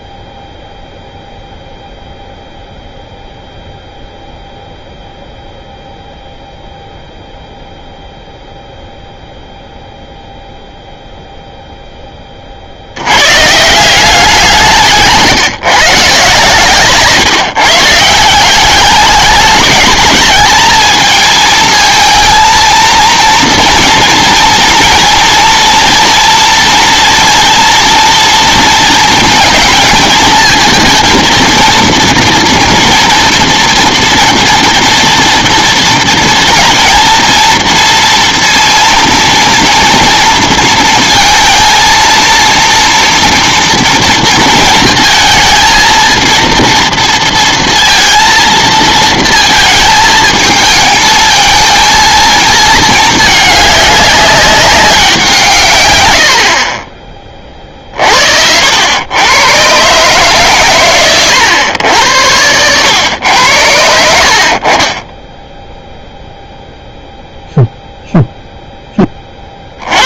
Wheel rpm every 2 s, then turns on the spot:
0, 0, 0, 0, 0, 0, 50, 170, 140, 200, 220, 230, 230, 230, 230, 230, 230, 230, 230, 230, 230, 230, 230, 230, 230, 220, 220, 200, 0, 80, 130, 90, 40, 0, 0.
none